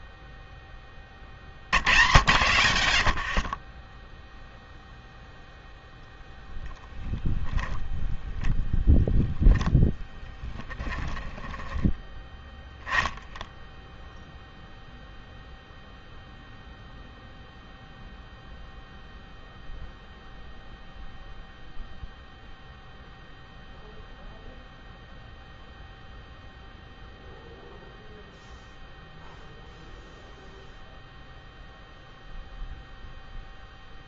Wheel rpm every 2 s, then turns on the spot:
50, 30, 0, 0, 0, 10, 0, 0, 0, 0, 0, 0, 0, 0, 0, 0, 0.
10-12